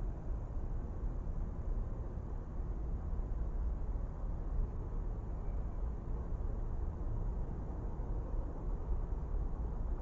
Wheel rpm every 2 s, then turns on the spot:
0, 0, 0, 0, 0.
none